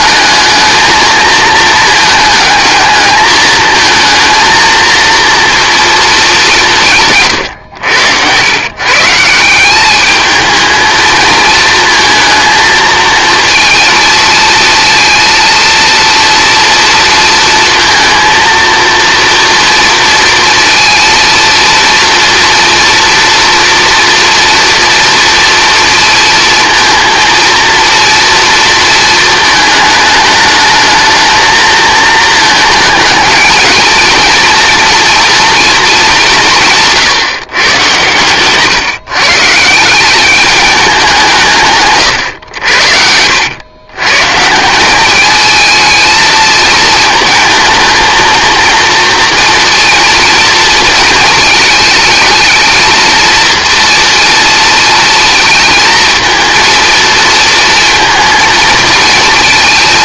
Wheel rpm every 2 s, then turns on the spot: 220, 220, 230, 190, 120, 220, 230, 230, 230, 230, 230, 230, 230, 230, 230, 220, 220, 230, 160, 130, 200, 80, 180, 220, 230, 230, 220, 230, 230, 230.
none